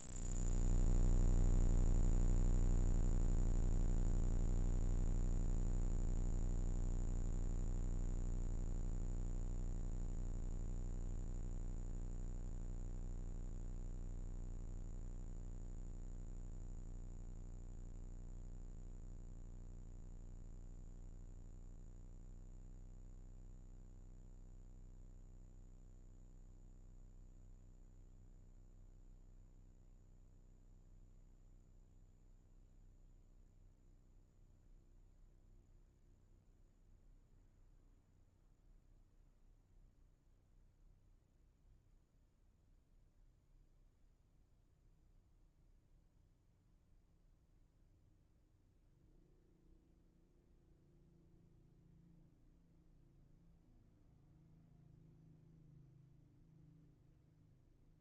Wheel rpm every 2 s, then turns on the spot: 0, 0, 0, 0, 0, 0, 0, 0, 0, 0, 0, 0, 0, 0, 0, 0, 0, 0, 0, 0, 0, 0, 0, 0, 0, 0, 0, 0, 0.
none